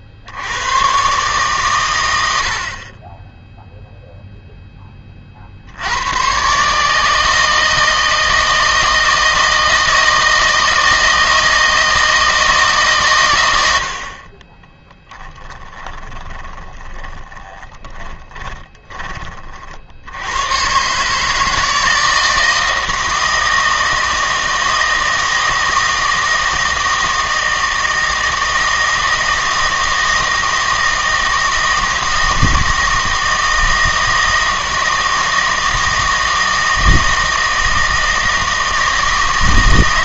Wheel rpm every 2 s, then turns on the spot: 60, 60, 10, 140, 160, 160, 150, 20, 10, 20, 120, 160, 160, 160, 160, 160, 160, 160, 160, 160.
14-20